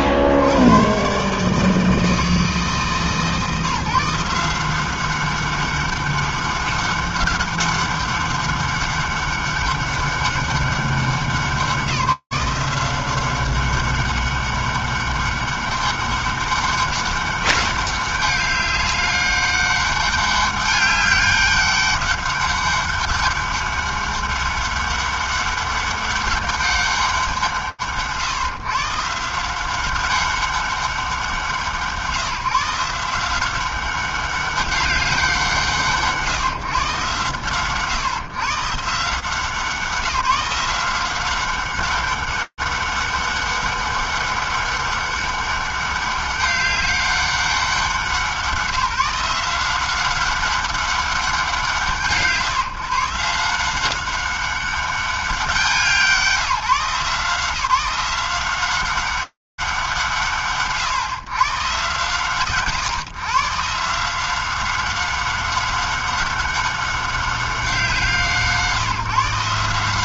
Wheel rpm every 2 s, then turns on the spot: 100, 150, 160, 200, 200, 200, 180, 200, 200, 200, 200, 200, 200, 200, 130, 200, 160, 200, 140, 140, 180, 200, 200, 200, 170, 200, 140, 200, 160, 180, 110, 130, 190, 200, 150.
none